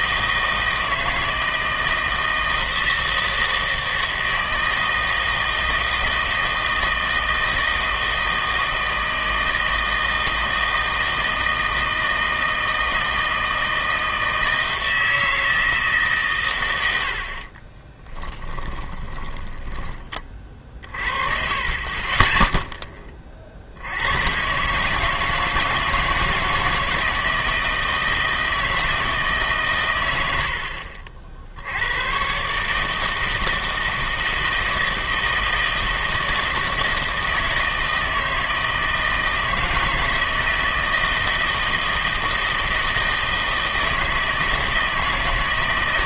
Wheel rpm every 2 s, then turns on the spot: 160, 160, 160, 160, 160, 160, 160, 160, 110, 20, 40, 0, 130, 160, 160, 70, 150, 160, 160, 160, 160, 160, 160.
18-20 30-32